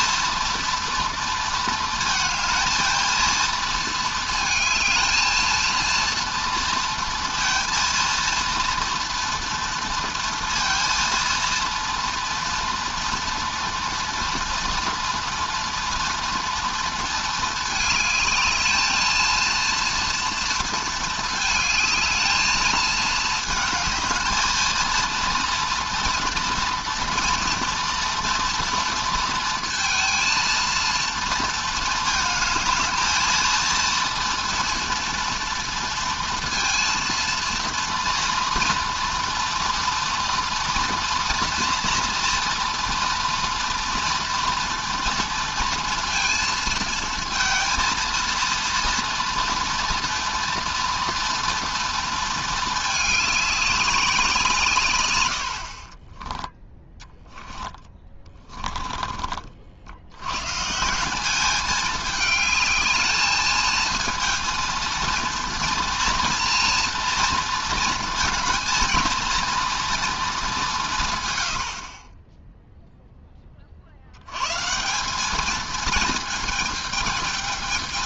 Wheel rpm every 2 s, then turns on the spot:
230, 230, 220, 230, 230, 230, 240, 230, 230, 220, 230, 220, 220, 230, 230, 230, 220, 230, 230, 240, 230, 230, 230, 220, 230, 230, 220, 150, 10, 20, 140, 220, 230, 240, 230, 190, 0, 160, 220.
56-60